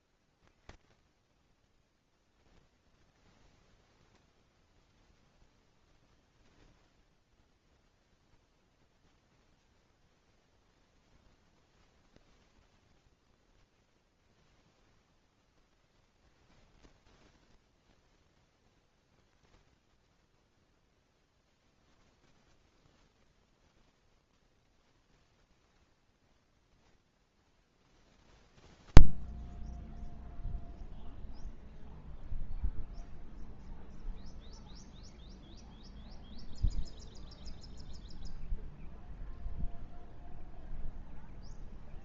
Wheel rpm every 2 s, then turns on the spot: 40, 0, 0, 0, 0, 0, 10, 0, 0, 10, 0, 0, 10, 10, 0, 0, 0, 0, 0, 0, 0.
none